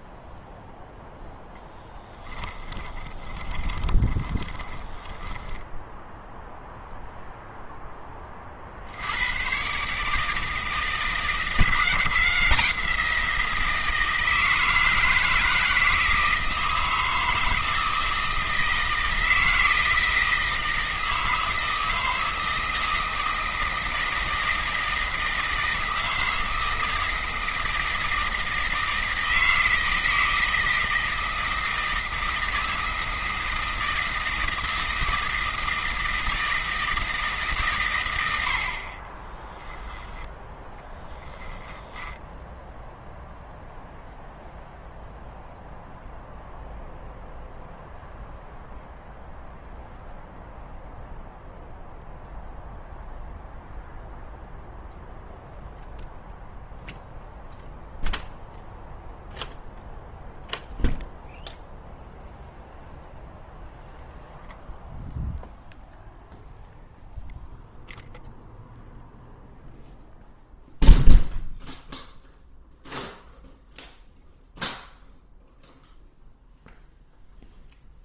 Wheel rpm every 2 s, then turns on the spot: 0, 10, 10, 0, 40, 160, 170, 160, 160, 160, 160, 160, 160, 160, 160, 160, 160, 160, 160, 70, 10, 0, 0, 0, 0, 0, 0, 0, 0, 0, 0, 0, 0, 0, 0, 0, 0, 0, 0.
2-6 40-42